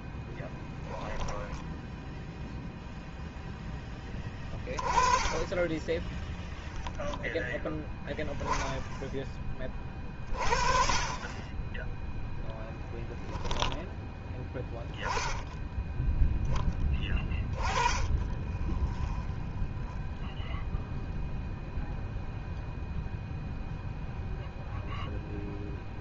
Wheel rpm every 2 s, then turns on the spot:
10, 0, 20, 0, 10, 30, 0, 10, 10, 10, 0, 0, 0.
0-2